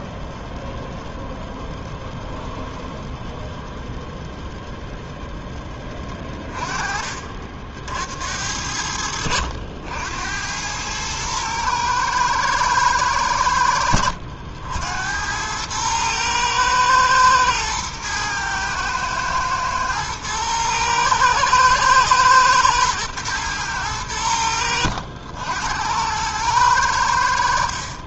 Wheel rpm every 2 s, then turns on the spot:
0, 0, 0, 30, 80, 100, 110, 80, 110, 110, 110, 110, 80, 100.
none